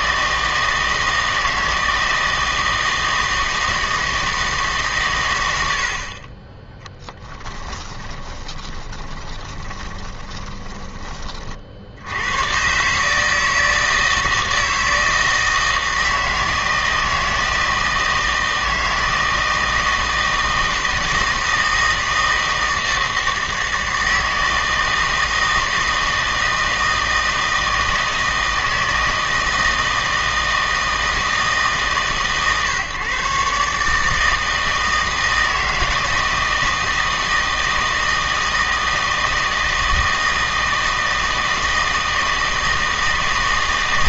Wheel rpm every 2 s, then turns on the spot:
160, 160, 150, 10, 20, 20, 130, 160, 160, 160, 160, 160, 160, 160, 160, 160, 140, 160, 160, 160, 160, 160.
8-10